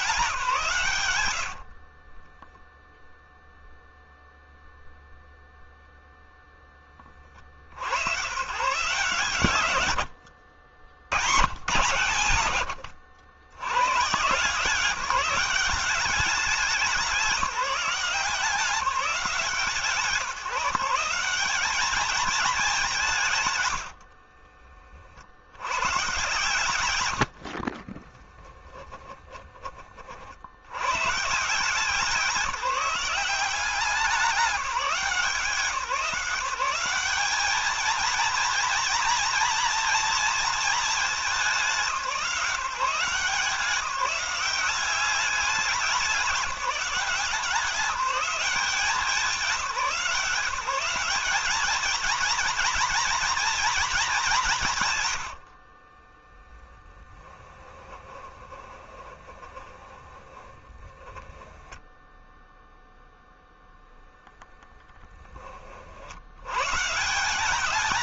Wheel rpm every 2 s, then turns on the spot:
130, 0, 0, 20, 150, 110, 110, 160, 200, 180, 150, 190, 50, 100, 10, 120, 190, 170, 190, 240, 220, 170, 200, 160, 180, 190, 240, 120, 10, 20, 10, 0, 10, 140.
28-30 56-62